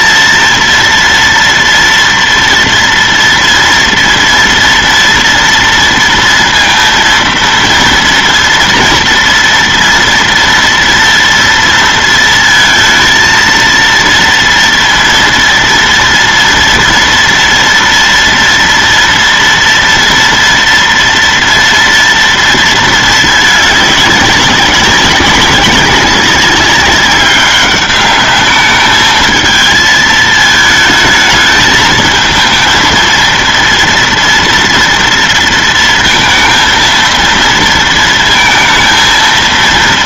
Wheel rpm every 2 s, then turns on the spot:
230, 230, 230, 230, 230, 230, 230, 230, 230, 240, 230, 230, 200, 190, 210, 220, 230, 230, 230, 230.
none